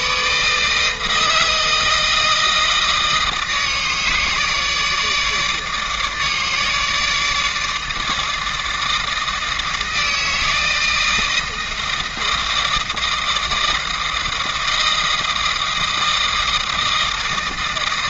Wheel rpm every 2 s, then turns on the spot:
160, 160, 150, 150, 160, 160, 160, 160, 160.
none